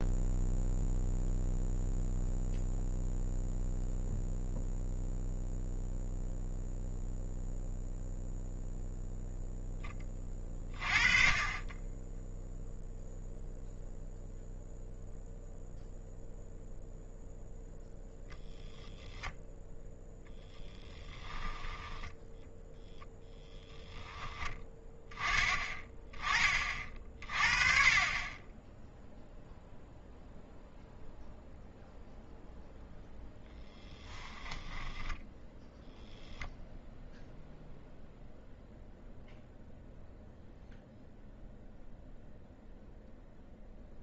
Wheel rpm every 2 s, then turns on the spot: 0, 0, 0, 0, 0, 30, 0, 0, 0, 0, 10, 0, 10, 30, 20, 0, 0, 10, 0, 0, 0, 0.
20-22 34-36